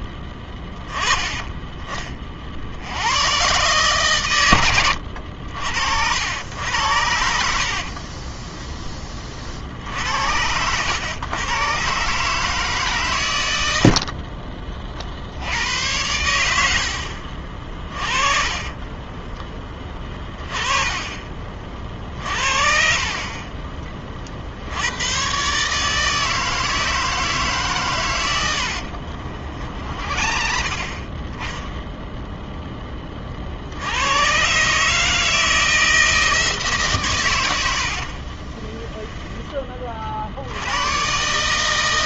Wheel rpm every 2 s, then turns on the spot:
20, 50, 110, 80, 10, 90, 150, 30, 80, 30, 20, 40, 80, 160, 90, 50, 10, 140, 150, 30, 80.
4-6 16-20 28-30 38-40